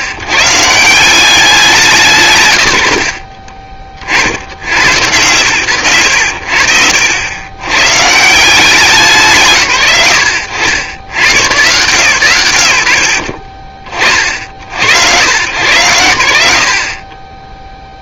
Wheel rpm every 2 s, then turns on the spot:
140, 140, 50, 80, 190, 90, 100, 50, 80.
6-8